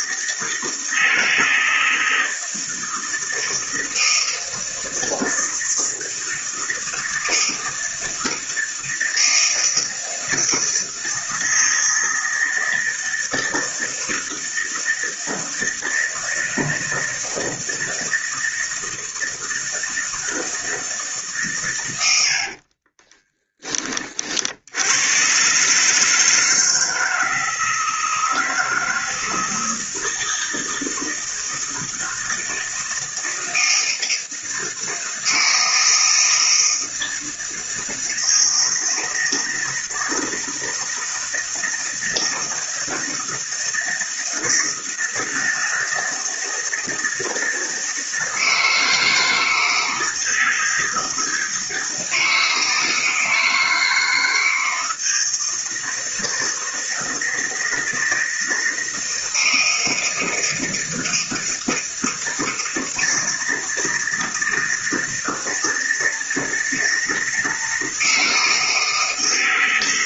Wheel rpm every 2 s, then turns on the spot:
160, 160, 160, 160, 160, 160, 160, 160, 160, 160, 160, 70, 60, 160, 160, 160, 160, 160, 160, 160, 160, 160, 160, 160, 160, 160, 160, 160, 160, 160, 160, 160, 160, 160, 160.
22-24